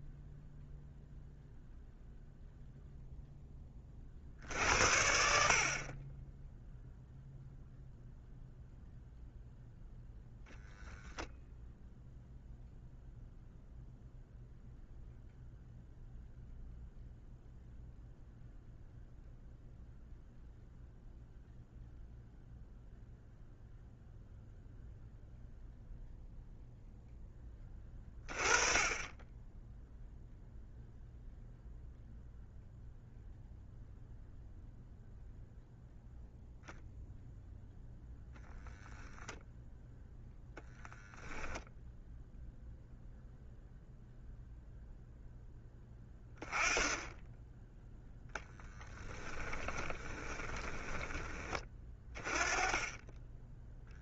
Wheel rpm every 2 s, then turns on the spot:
0, 0, 70, 0, 0, 0, 0, 0, 0, 0, 0, 0, 0, 0, 20, 0, 0, 0, 0, 0, 10, 0, 0, 10, 20, 20, 20.
48-50